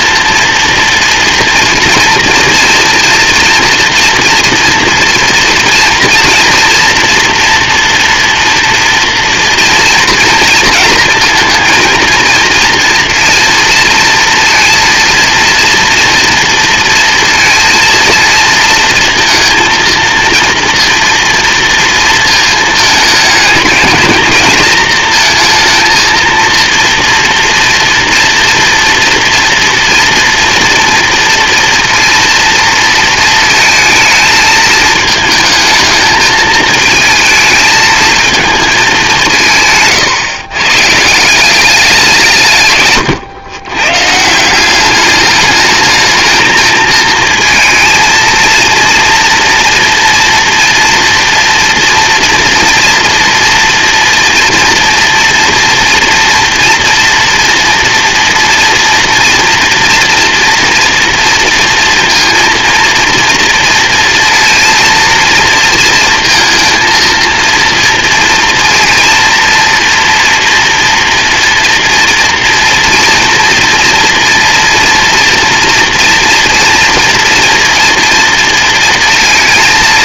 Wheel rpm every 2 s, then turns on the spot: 230, 240, 230, 240, 230, 230, 230, 230, 230, 230, 230, 220, 230, 230, 230, 240, 220, 220, 220, 170, 170, 120, 210, 230, 230, 230, 240, 230, 240, 230, 230, 240, 230, 230, 240, 230, 230, 230, 230, 230.
none